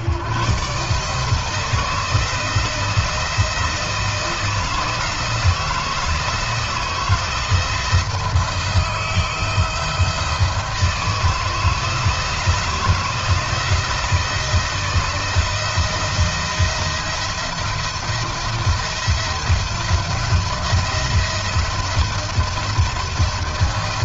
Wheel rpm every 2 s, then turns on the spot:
160, 170, 160, 160, 160, 160, 160, 170, 160, 170, 170, 170.
none